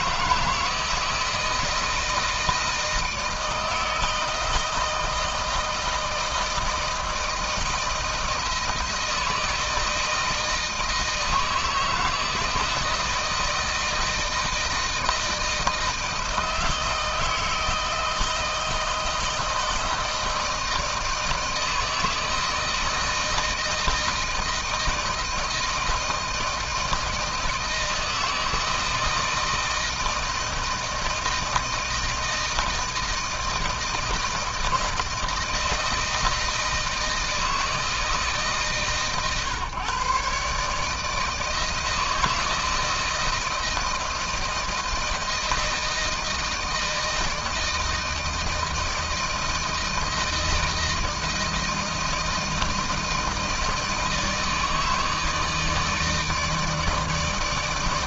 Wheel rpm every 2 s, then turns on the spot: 160, 160, 160, 160, 160, 160, 160, 160, 160, 170, 160, 160, 160, 160, 160, 160, 160, 160, 160, 140, 140, 160, 160, 160, 160, 160, 160, 160, 160.
none